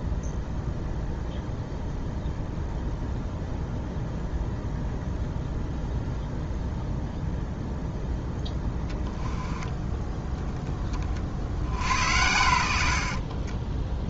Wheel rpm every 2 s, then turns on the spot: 0, 0, 0, 0, 10, 20, 70.
none